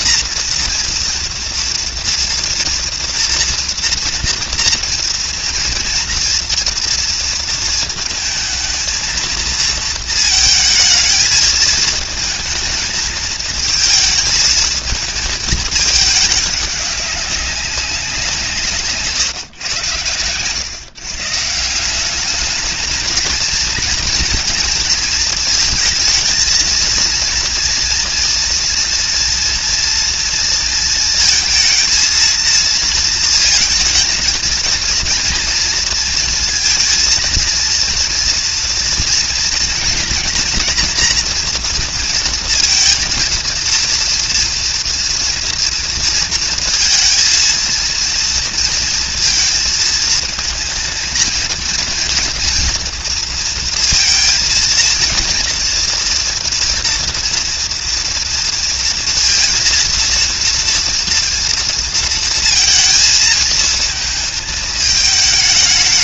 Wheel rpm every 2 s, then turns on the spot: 230, 230, 230, 230, 220, 220, 220, 220, 200, 150, 140, 220, 230, 230, 240, 230, 220, 220, 230, 230, 230, 230, 240, 220, 230, 230, 230, 230, 230, 230, 230, 220, 220.
none